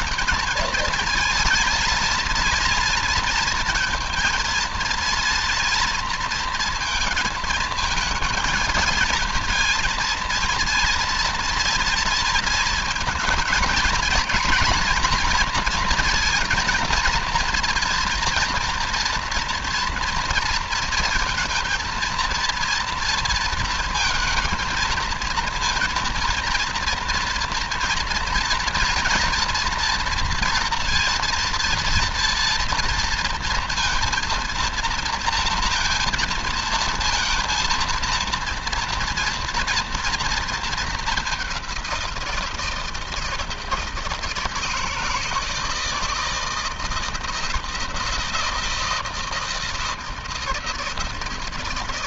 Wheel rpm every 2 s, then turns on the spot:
230, 230, 230, 230, 230, 230, 230, 230, 230, 230, 230, 230, 220, 230, 230, 230, 230, 230, 230, 230, 220, 170, 160, 160, 160, 160.
none